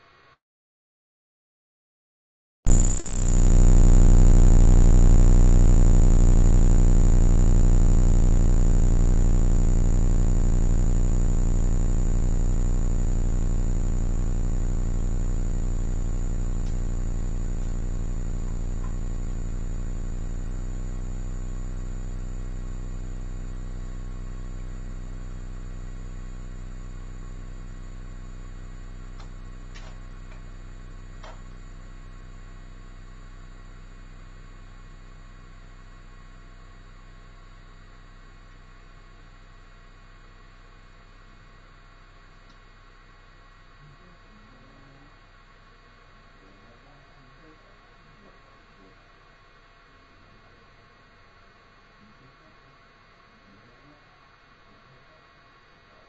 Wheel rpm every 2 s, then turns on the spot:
0, 0, 0, 0, 0, 0, 0, 0, 0, 0, 0, 0, 0, 0, 0, 0, 0, 0, 0, 0, 0, 0, 0, 0, 0, 0, 0, 0.
none